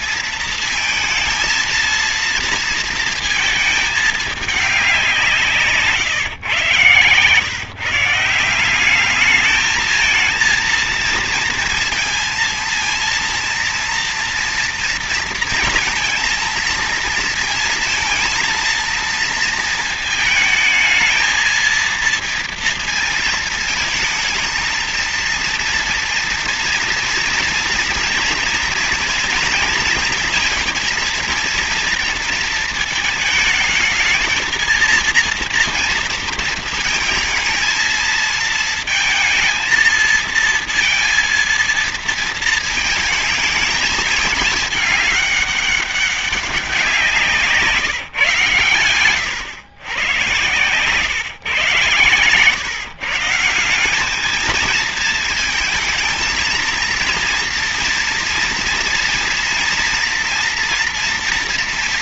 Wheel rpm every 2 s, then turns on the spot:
230, 230, 210, 130, 170, 230, 230, 230, 230, 230, 220, 230, 230, 230, 230, 230, 230, 230, 220, 220, 230, 220, 210, 190, 130, 120, 130, 210, 230, 230, 230.
none